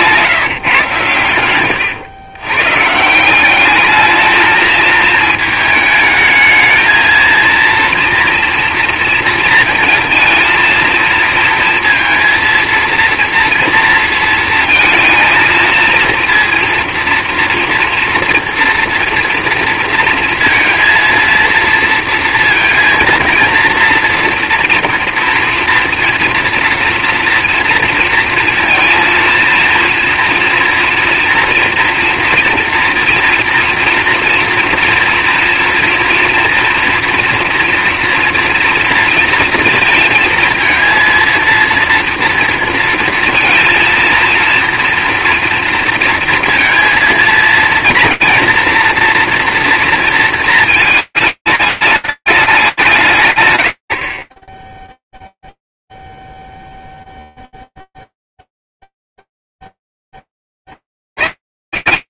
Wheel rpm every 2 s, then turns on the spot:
160, 130, 220, 220, 240, 230, 230, 230, 240, 230, 230, 230, 240, 230, 230, 230, 230, 230, 230, 230, 230, 230, 230, 230, 230, 220, 190, 10, 0, 0, 10.
none